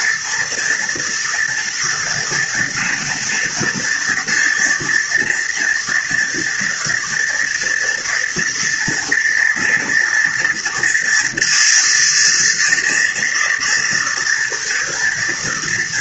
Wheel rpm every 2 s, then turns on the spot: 230, 230, 240, 230, 230, 230, 230, 230.
none